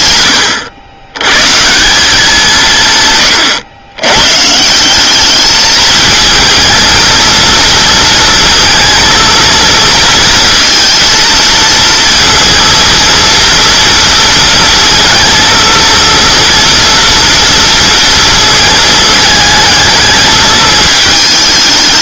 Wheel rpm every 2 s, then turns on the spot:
110, 140, 160, 220, 230, 230, 230, 230, 230, 220, 220.
none